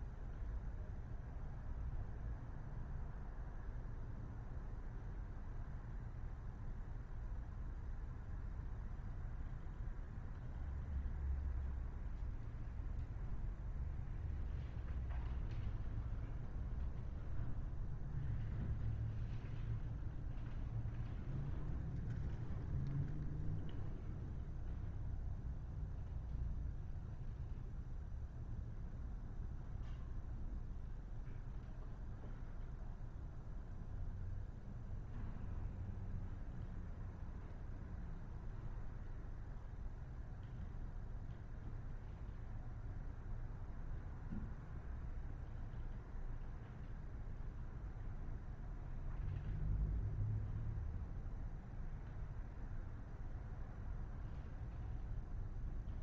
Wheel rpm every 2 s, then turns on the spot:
0, 0, 0, 0, 0, 0, 0, 0, 0, 0, 0, 0, 0, 0, 0, 0, 0, 0, 0, 0, 0, 0, 0, 0, 0, 0, 0, 0.
none